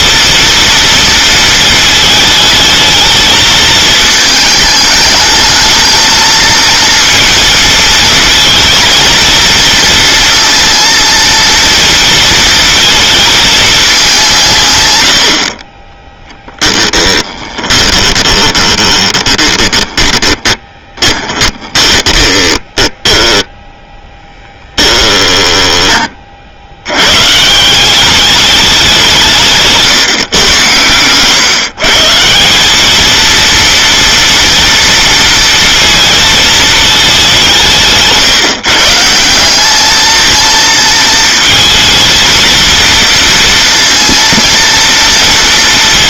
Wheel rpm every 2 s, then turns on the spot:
230, 220, 220, 230, 230, 230, 230, 130, 10, 20, 20, 10, 10, 80, 200, 120, 190, 230, 220, 150, 230, 230, 230.
16-22